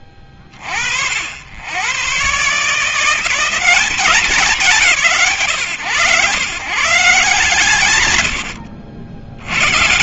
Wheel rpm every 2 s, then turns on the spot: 40, 130, 200, 130, 90.
8-10